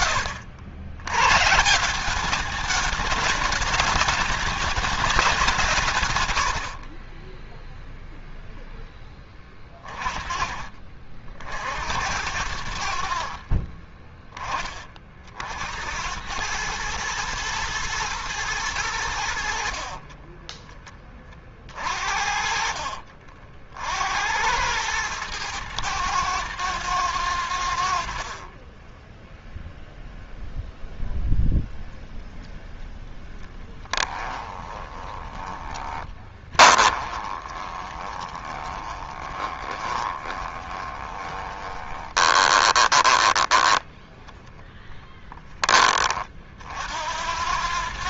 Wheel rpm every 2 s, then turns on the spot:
90, 200, 220, 90, 0, 30, 60, 20, 110, 100, 20, 50, 100, 110, 30, 0, 0, 20, 20, 20, 20, 20, 20, 50.
6-8 28-30 34-44